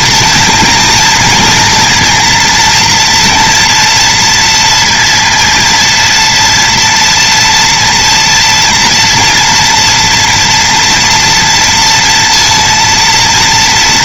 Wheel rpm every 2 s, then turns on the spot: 230, 230, 230, 230, 230, 240, 230.
none